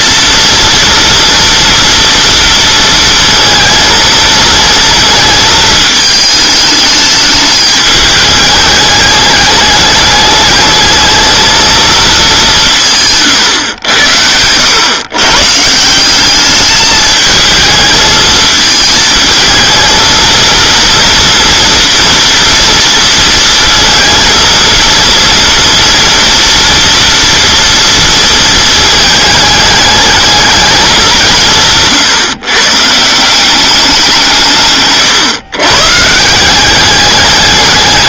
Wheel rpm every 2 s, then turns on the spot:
230, 230, 220, 210, 210, 210, 180, 120, 210, 220, 230, 230, 230, 230, 230, 210, 140, 150, 190.
none